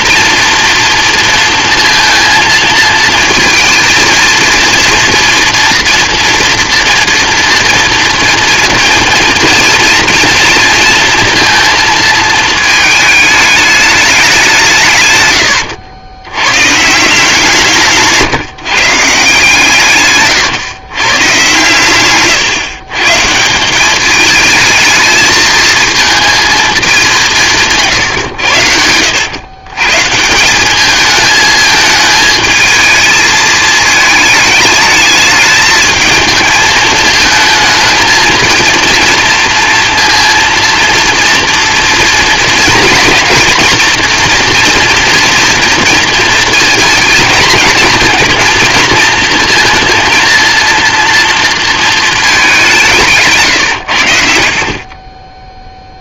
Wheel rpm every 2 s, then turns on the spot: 230, 230, 230, 230, 230, 230, 220, 170, 120, 150, 120, 140, 210, 220, 80, 190, 220, 210, 220, 220, 230, 230, 230, 230, 230, 230, 190, 50.
none